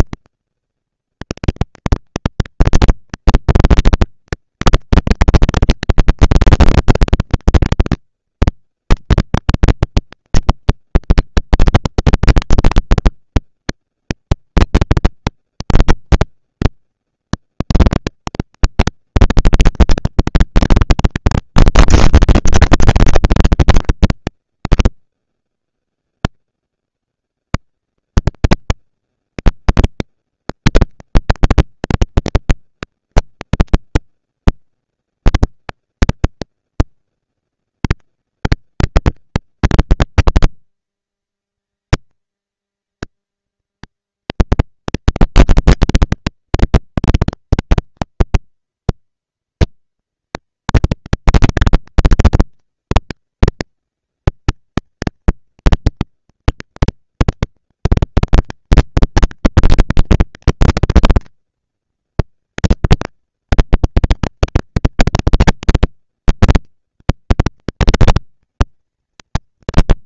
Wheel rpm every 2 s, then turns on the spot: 230, 230, 230, 230, 230, 230, 230, 220, 230, 220, 230, 200, 170, 90, 180, 230, 230, 230, 230, 230, 230, 220, 230, 230, 230, 230, 230, 230, 230, 230, 240, 230, 230, 230, 230.
none